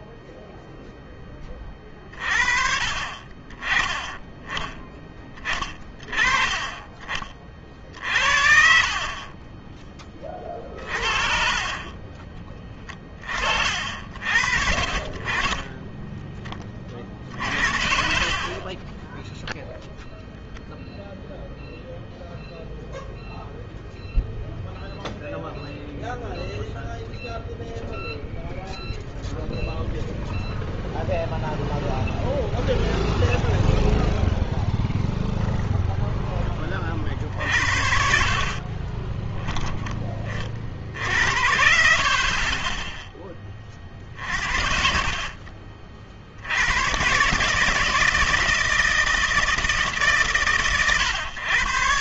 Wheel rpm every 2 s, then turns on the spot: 0, 40, 20, 30, 60, 50, 30, 50, 30, 20, 0, 0, 0, 0, 0, 0, 0, 0, 20, 30, 50, 20, 50, 100, 160, 120.
14-16 38-40